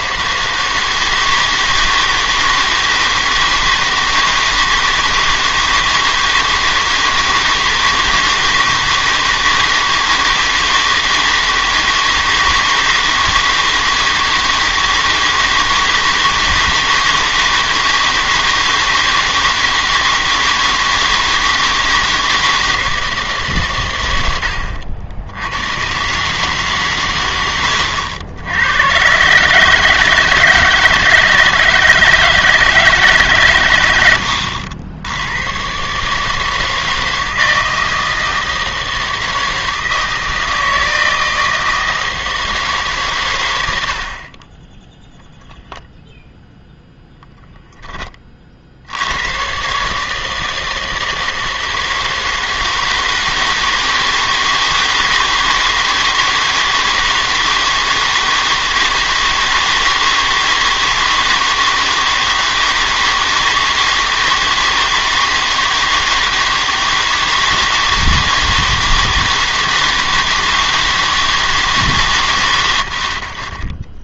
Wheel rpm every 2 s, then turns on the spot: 160, 160, 160, 160, 160, 160, 160, 160, 160, 160, 160, 160, 80, 140, 90, 160, 160, 80, 160, 160, 160, 160, 10, 0, 50, 160, 160, 160, 160, 160, 160, 160, 160, 160, 160, 160, 120.
none